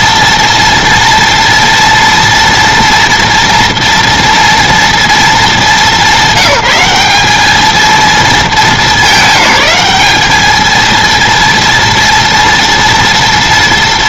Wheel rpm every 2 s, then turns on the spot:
230, 230, 230, 190, 220, 220, 230.
none